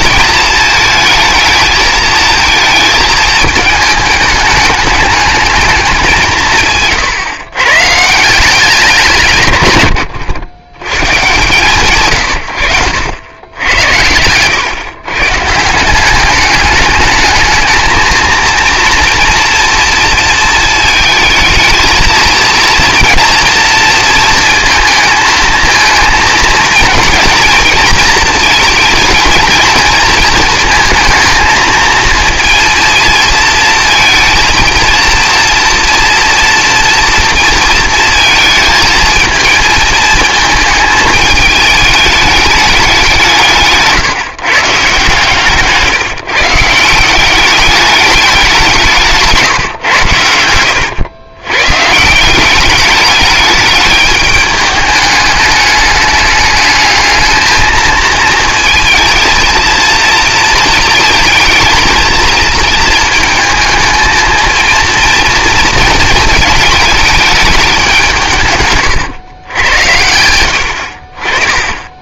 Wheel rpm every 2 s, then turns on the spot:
220, 220, 210, 150, 170, 120, 100, 120, 210, 230, 220, 220, 220, 230, 230, 220, 230, 230, 230, 220, 220, 210, 140, 160, 180, 100, 200, 210, 210, 230, 230, 230, 230, 220, 140, 80.
50-52